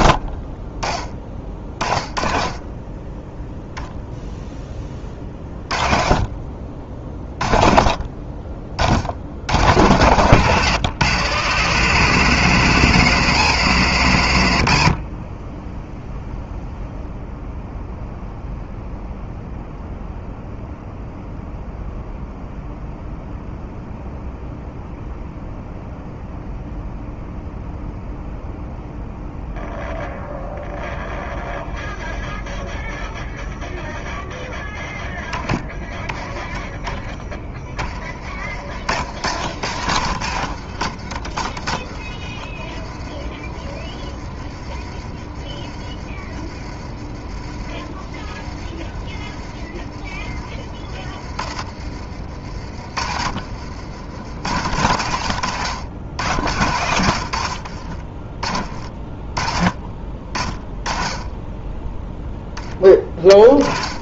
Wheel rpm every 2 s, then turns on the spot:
20, 20, 10, 40, 50, 130, 140, 60, 0, 0, 0, 0, 0, 0, 0, 0, 0, 0, 10, 60, 70, 40, 30, 40, 30, 30, 60, 80, 80, 30, 20, 10.
38-44 46-48 52-54